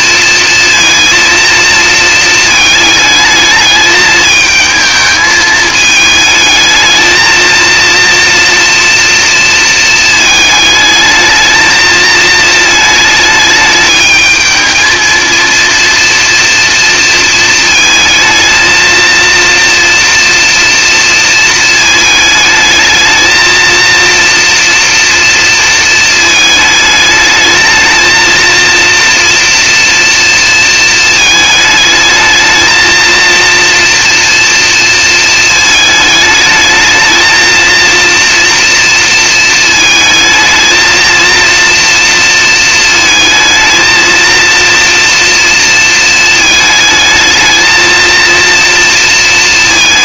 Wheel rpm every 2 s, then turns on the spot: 230, 220, 220, 220, 230, 210, 220, 220, 230, 220, 230, 220, 230, 220, 230, 220, 230, 230, 220, 230, 230, 220, 230, 220, 230.
none